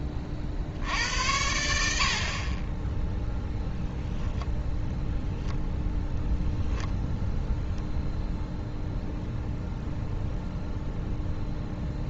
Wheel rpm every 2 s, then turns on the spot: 60, 20, 10, 0, 0, 0.
none